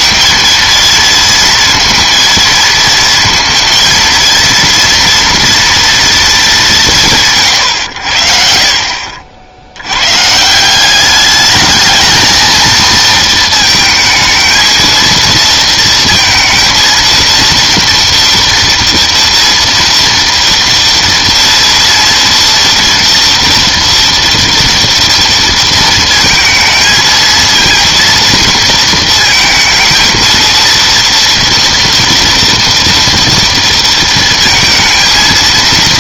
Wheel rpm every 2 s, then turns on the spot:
230, 220, 230, 200, 50, 170, 230, 230, 230, 230, 230, 230, 230, 220, 220, 230, 230, 230.
none